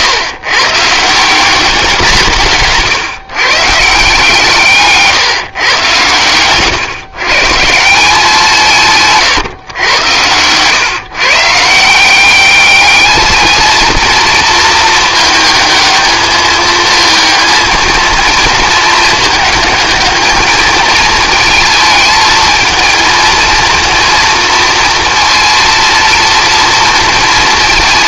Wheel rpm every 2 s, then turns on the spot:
140, 150, 150, 130, 160, 130, 210, 220, 220, 220, 220, 220, 230, 230.
none